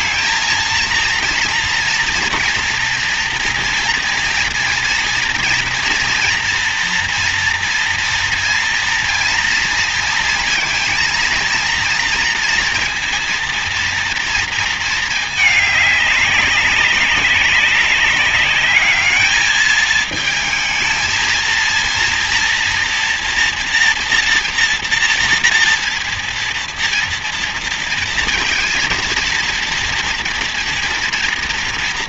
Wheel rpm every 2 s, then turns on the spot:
230, 230, 230, 230, 230, 230, 230, 230, 200, 200, 220, 230, 230, 230, 230, 230.
none